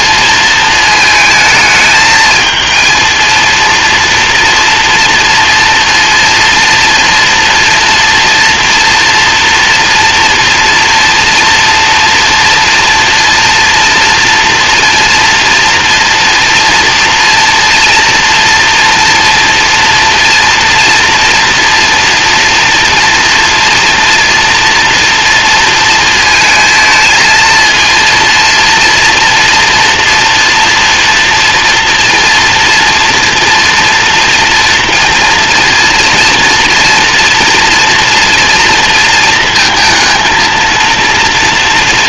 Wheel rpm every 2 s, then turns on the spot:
220, 220, 230, 230, 230, 230, 230, 230, 230, 240, 230, 240, 230, 220, 230, 230, 230, 230, 240, 230, 230.
none